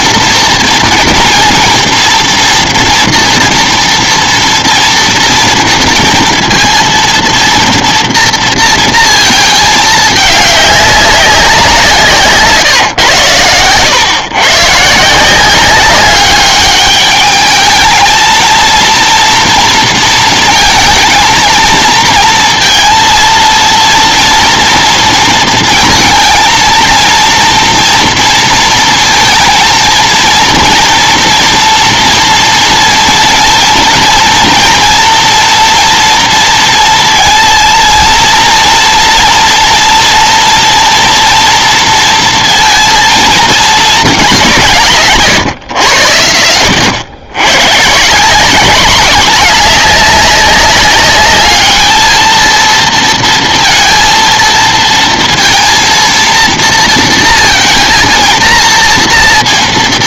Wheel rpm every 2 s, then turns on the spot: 230, 230, 230, 230, 220, 190, 110, 170, 210, 230, 230, 230, 230, 230, 230, 230, 230, 230, 220, 230, 230, 220, 140, 90, 210, 210, 230, 230, 230, 230.
none